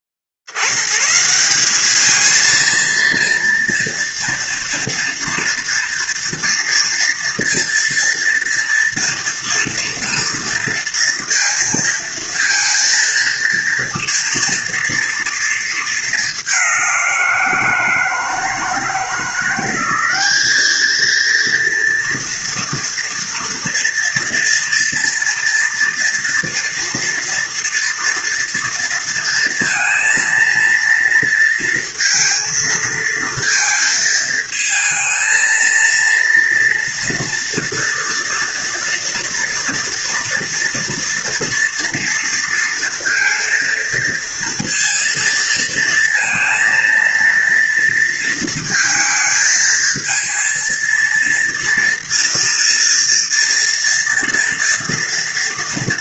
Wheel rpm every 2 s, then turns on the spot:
50, 220, 230, 230, 230, 230, 230, 230, 200, 160, 210, 230, 230, 230, 230, 230, 230, 220, 230, 230, 230, 230, 230, 230, 230, 230, 230, 230.
none